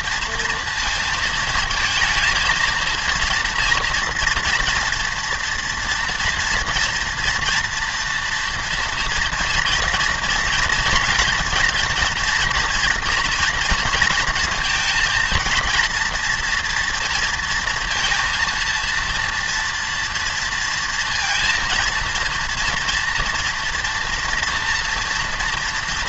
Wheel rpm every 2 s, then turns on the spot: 230, 230, 230, 230, 240, 230, 240, 230, 240, 230, 230, 230, 230.
none